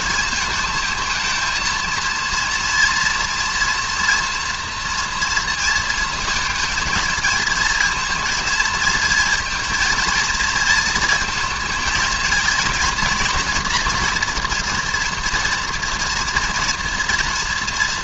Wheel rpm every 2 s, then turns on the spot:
220, 230, 230, 220, 230, 220, 230, 240, 230.
none